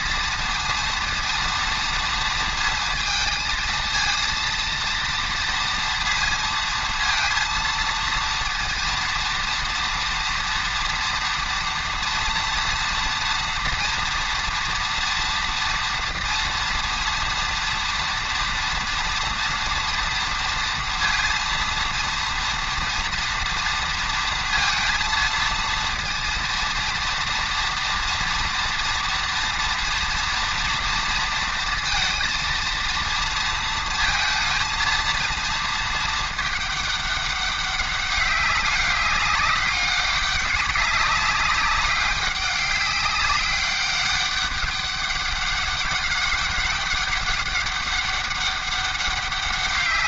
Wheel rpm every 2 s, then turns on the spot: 230, 230, 230, 230, 230, 230, 240, 230, 230, 230, 230, 230, 230, 230, 230, 230, 230, 230, 210, 200, 200, 200, 200, 200, 200.
none